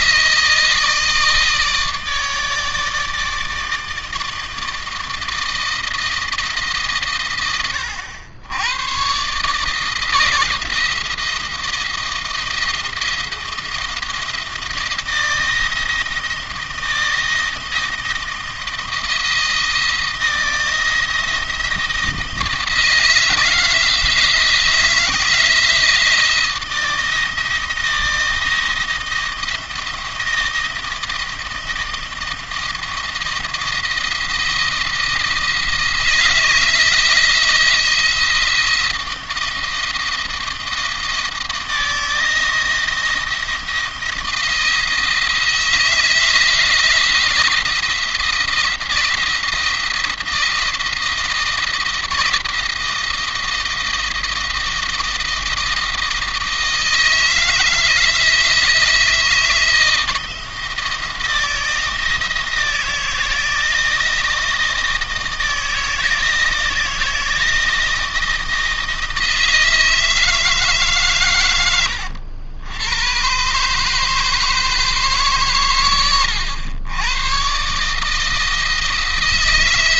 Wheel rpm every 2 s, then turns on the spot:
160, 160, 160, 150, 110, 170, 170, 160, 160, 170, 160, 160, 160, 170, 160, 160, 170, 170, 160, 170, 160, 170, 160, 170, 170, 170, 160, 160, 160, 170, 170, 160, 170, 160, 160, 150, 90, 160, 110, 160.
none